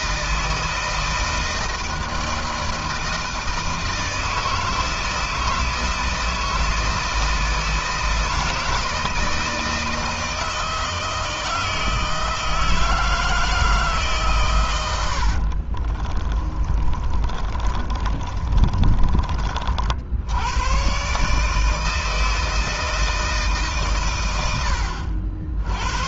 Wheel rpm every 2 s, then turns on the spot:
160, 160, 160, 160, 160, 160, 160, 130, 40, 30, 100, 160, 100.
14-20